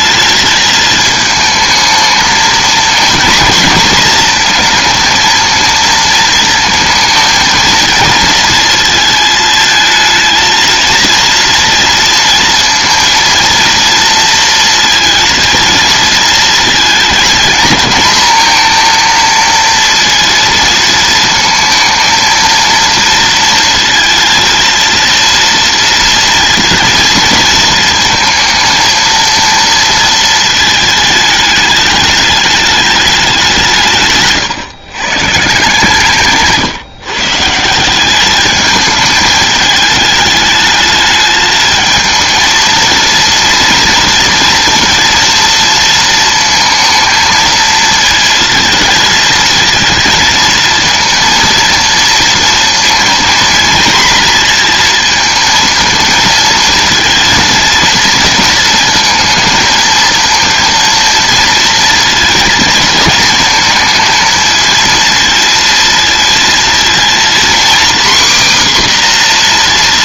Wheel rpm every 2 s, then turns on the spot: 220, 230, 230, 230, 230, 230, 230, 230, 230, 230, 230, 230, 230, 230, 230, 220, 210, 130, 140, 210, 210, 230, 230, 220, 220, 230, 230, 230, 230, 230, 230, 220, 230, 230, 260.
36-38